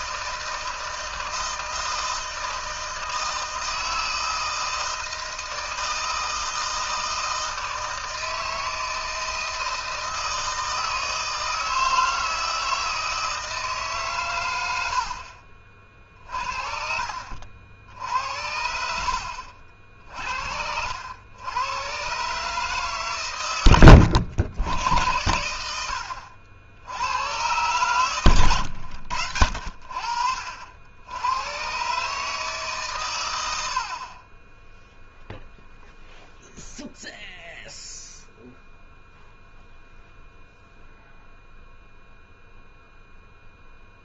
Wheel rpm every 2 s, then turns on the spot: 160, 160, 160, 160, 160, 160, 160, 90, 50, 70, 80, 150, 90, 80, 100, 70, 130, 0, 0, 0, 0, 0.
none